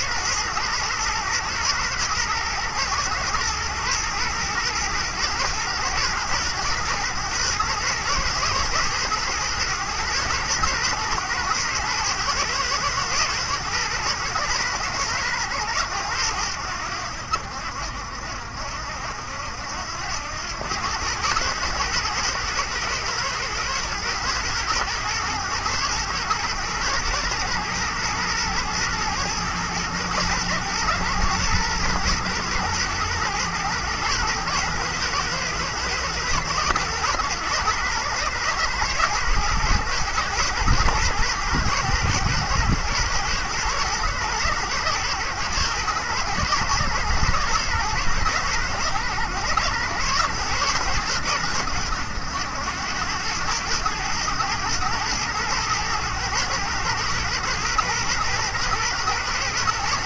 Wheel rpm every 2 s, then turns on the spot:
110, 110, 110, 110, 120, 120, 110, 110, 90, 70, 100, 110, 110, 120, 120, 110, 110, 110, 110, 110, 120, 110, 120, 110, 110, 110, 90, 110, 110, 120.
none